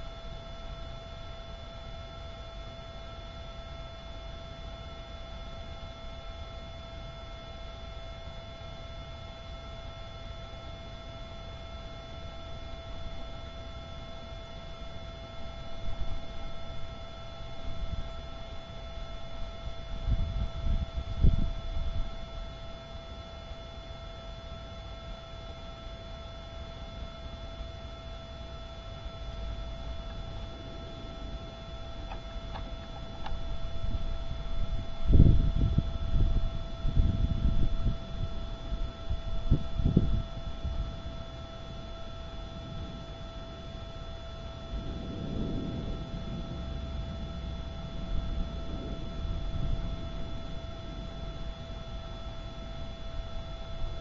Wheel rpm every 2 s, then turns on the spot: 0, 0, 0, 0, 0, 0, 0, 0, 0, 0, 0, 0, 0, 0, 0, 0, 0, 0, 0, 0, 0, 0, 0, 0, 0, 0, 0.
none